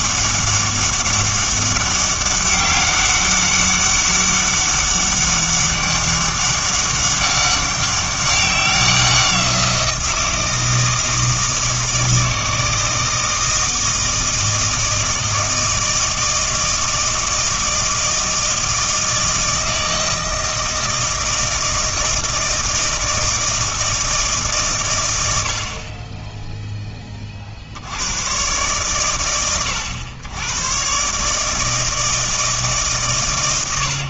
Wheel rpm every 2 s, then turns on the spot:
200, 200, 200, 200, 190, 160, 160, 160, 160, 160, 160, 160, 140, 10, 120, 120, 160.
none